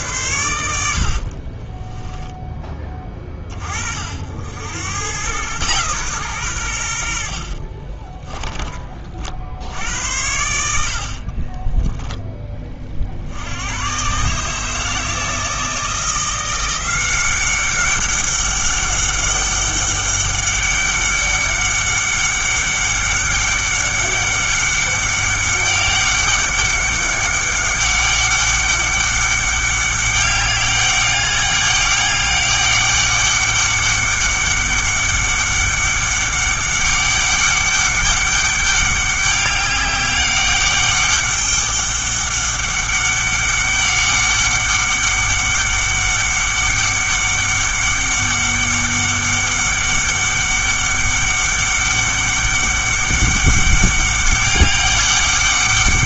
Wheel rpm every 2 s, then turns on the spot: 80, 10, 90, 100, 20, 70, 30, 150, 180, 200, 200, 200, 200, 200, 200, 200, 200, 200, 200, 200, 200, 200, 200, 200, 200, 200, 200, 200.
none